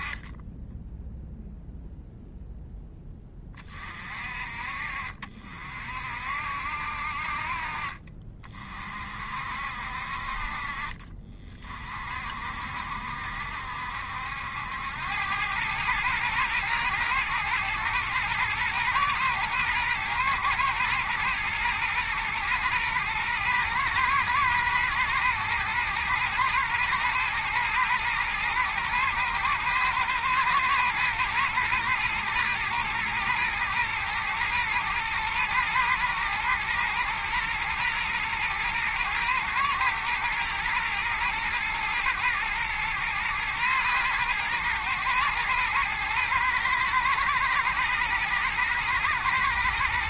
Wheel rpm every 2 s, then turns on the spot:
10, 10, 50, 60, 40, 40, 60, 90, 120, 120, 120, 110, 110, 120, 110, 110, 110, 120, 120, 110, 120, 110, 110, 120, 120.
none